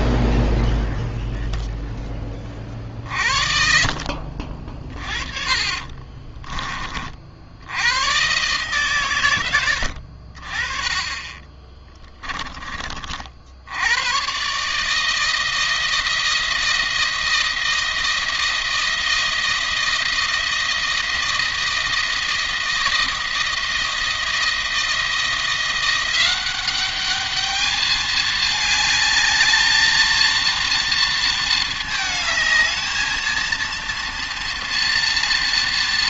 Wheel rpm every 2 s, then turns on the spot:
0, 40, 40, 40, 120, 40, 40, 150, 160, 160, 160, 160, 160, 200, 210, 230, 220, 230.
10-12